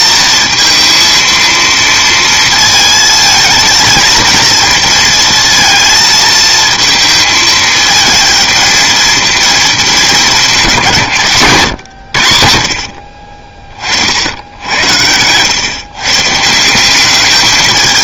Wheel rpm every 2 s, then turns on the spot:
230, 220, 220, 220, 220, 160, 60, 90, 170.
none